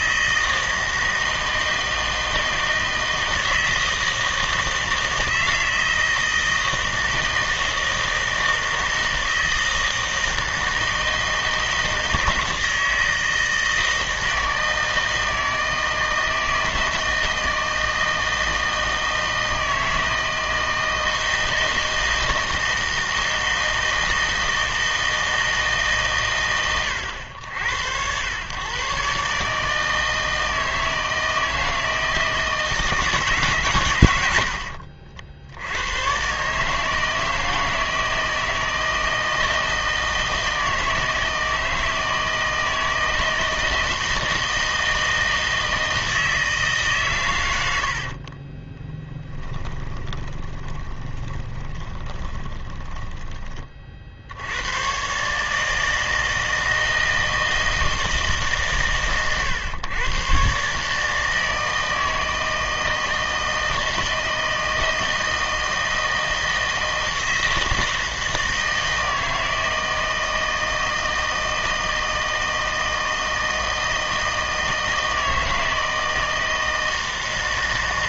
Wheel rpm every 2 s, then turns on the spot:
160, 160, 160, 160, 160, 160, 160, 160, 160, 160, 160, 160, 160, 100, 130, 160, 160, 60, 150, 160, 160, 160, 160, 140, 20, 20, 20, 110, 160, 140, 150, 160, 160, 160, 160, 160, 160, 160, 160.
34-36 48-54